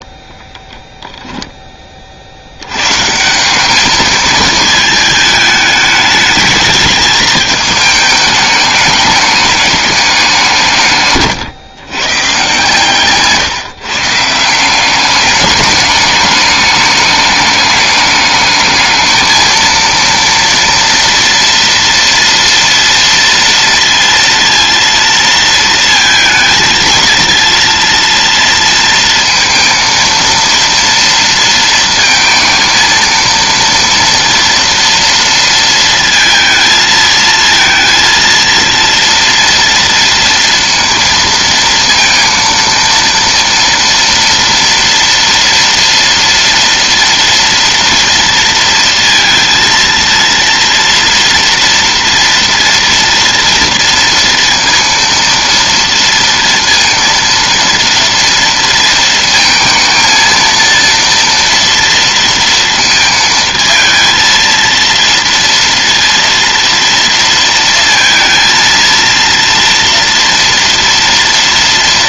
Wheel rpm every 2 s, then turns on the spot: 10, 100, 220, 210, 210, 160, 140, 180, 210, 210, 230, 230, 230, 220, 230, 230, 230, 230, 220, 230, 230, 230, 230, 230, 230, 230, 230, 230, 230, 230, 230, 230, 230, 230, 230, 230.
12-14